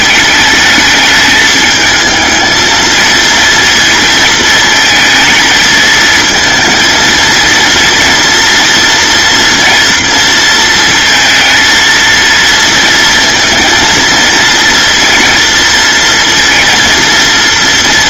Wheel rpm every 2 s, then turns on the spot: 220, 220, 220, 220, 230, 230, 230, 230, 230.
none